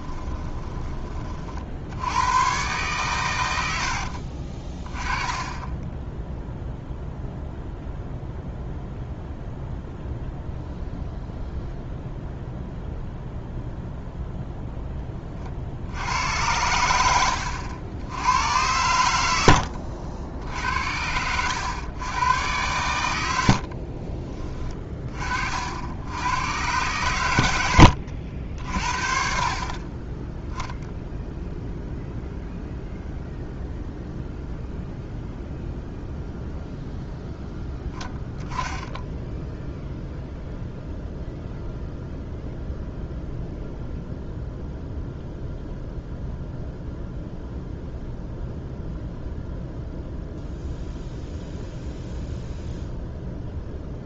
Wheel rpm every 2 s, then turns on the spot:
20, 120, 30, 0, 0, 0, 0, 10, 90, 90, 80, 100, 30, 100, 60, 0, 0, 0, 0, 10, 0, 0, 0, 0, 0, 0, 0.
none